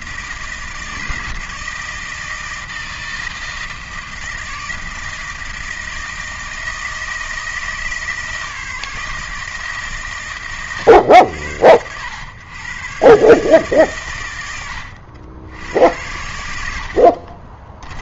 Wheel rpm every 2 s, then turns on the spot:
160, 160, 160, 160, 150, 130, 120, 90, 80.
none